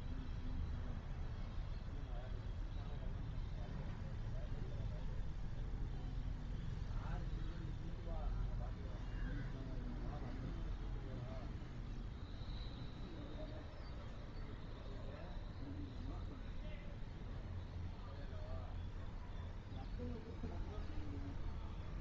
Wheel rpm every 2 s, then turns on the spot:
0, 0, 0, 0, 0, 0, 0, 0, 0, 0, 0.
none